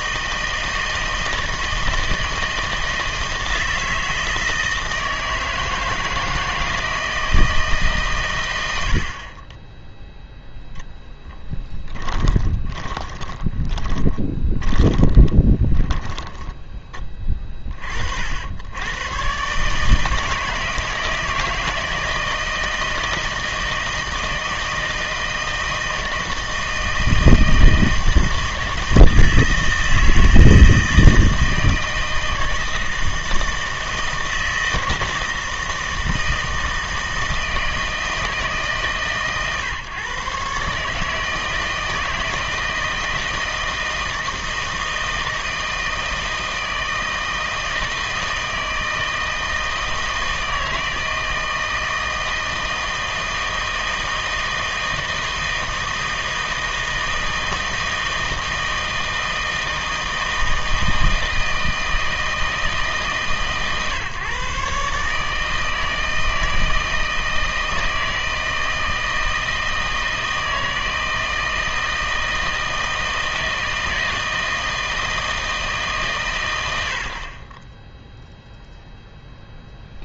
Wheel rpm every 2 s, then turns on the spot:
160, 160, 160, 160, 150, 10, 20, 10, 20, 40, 150, 160, 160, 160, 160, 160, 160, 160, 160, 160, 130, 160, 160, 160, 160, 160, 160, 160, 160, 160, 160, 160, 140, 160, 160, 160, 160, 160, 150, 10.
12-18